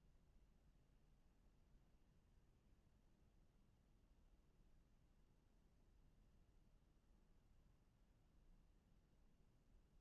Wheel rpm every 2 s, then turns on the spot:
0, 0, 0, 0, 0.
none